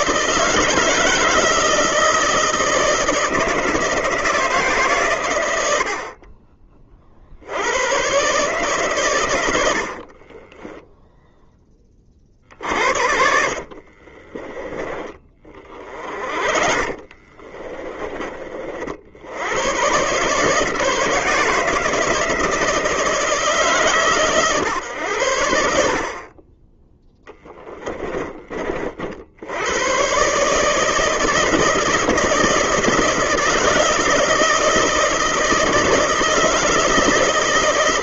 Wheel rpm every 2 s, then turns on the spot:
160, 160, 130, 40, 130, 10, 60, 20, 40, 50, 150, 160, 110, 20, 50, 160, 160, 160, 160.
10-14 16-18